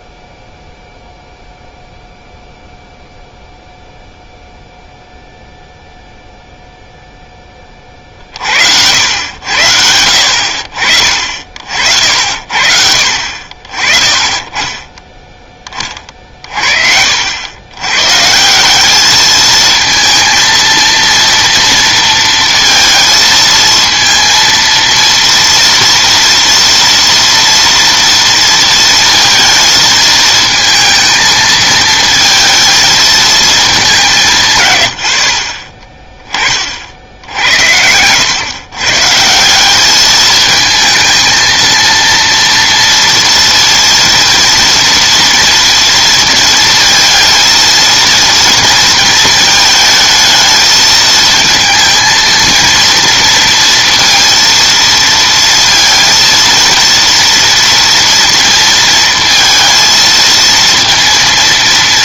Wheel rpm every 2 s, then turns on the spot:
0, 0, 0, 0, 60, 60, 50, 30, 40, 180, 230, 230, 230, 230, 230, 220, 220, 130, 40, 130, 220, 230, 230, 230, 230, 220, 230, 230, 230, 230, 230.
none